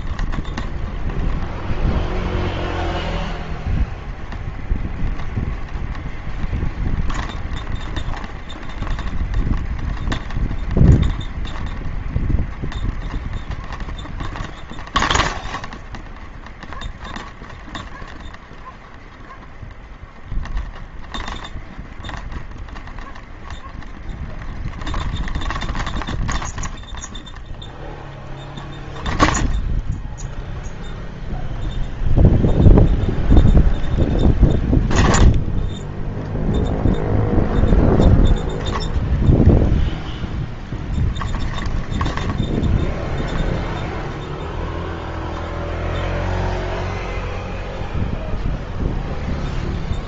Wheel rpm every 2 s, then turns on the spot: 0, 0, 0, 0, 0, 0, 0, 0, 0, 0, 0, 0, 0, 0, 0, 0, 0, 0, 0, 0, 0, 0, 0, 0, 0.
none